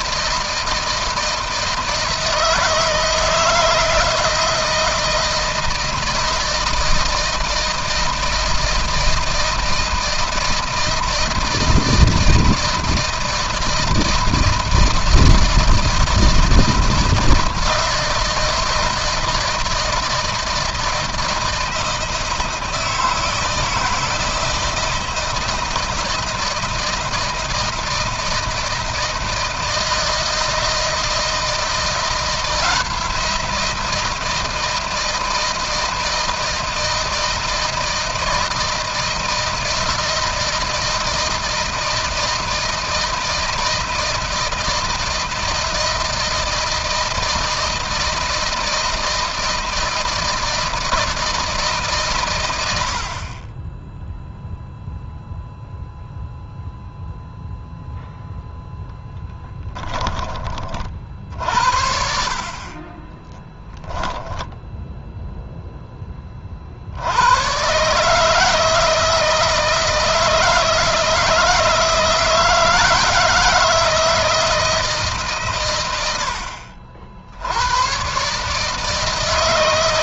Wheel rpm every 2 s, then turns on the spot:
160, 160, 160, 160, 160, 160, 160, 160, 160, 160, 160, 160, 160, 170, 160, 160, 170, 160, 160, 160, 160, 160, 160, 160, 160, 160, 80, 0, 0, 0, 40, 40, 0, 60, 160, 160, 170, 160, 70, 150.
62-64